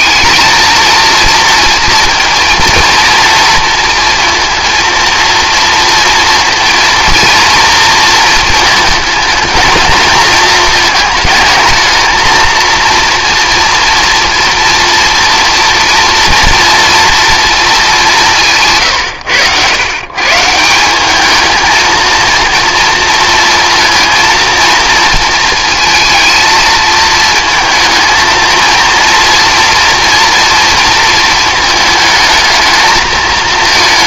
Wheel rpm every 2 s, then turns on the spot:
230, 230, 230, 230, 220, 220, 230, 230, 230, 170, 170, 230, 230, 220, 230, 230, 220.
none